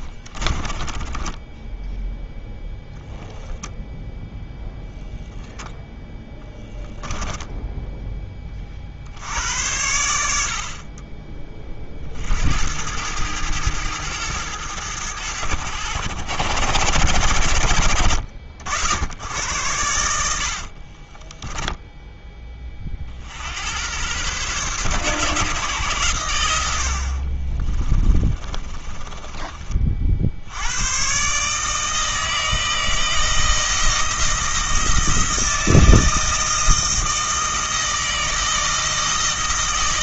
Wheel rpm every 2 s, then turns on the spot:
20, 0, 0, 10, 40, 50, 80, 110, 120, 70, 60, 30, 130, 90, 30, 90, 160, 160, 160, 160.
0-2 20-22 28-30